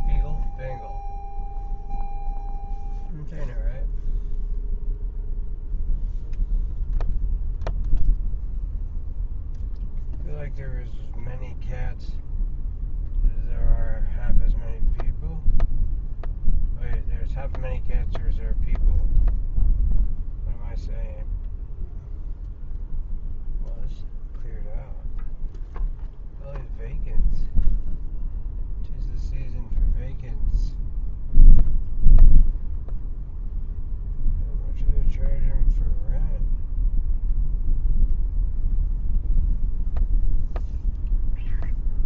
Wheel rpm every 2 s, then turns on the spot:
0, 0, 0, 0, 0, 0, 0, 0, 0, 0, 0, 0, 0, 0, 0, 0, 0, 0, 0, 0, 0.
none